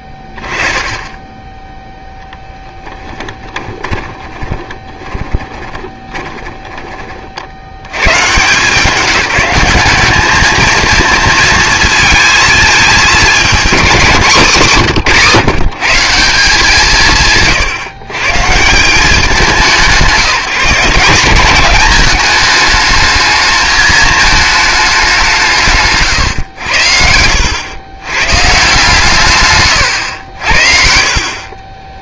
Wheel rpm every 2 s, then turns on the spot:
10, 10, 20, 30, 160, 220, 220, 180, 180, 140, 180, 210, 210, 100, 140, 60.
4-6